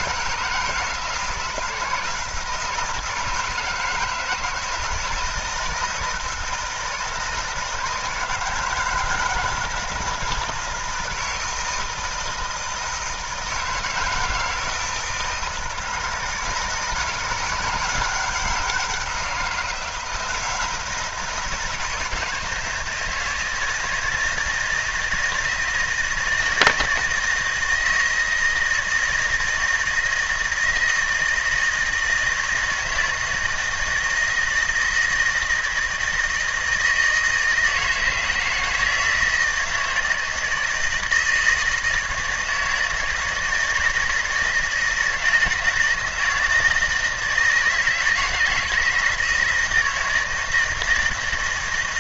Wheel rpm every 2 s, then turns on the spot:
160, 160, 160, 160, 160, 160, 160, 160, 160, 180, 170, 160, 170, 160, 160, 160, 160, 160, 160, 160, 160, 160, 160, 160, 160, 160.
none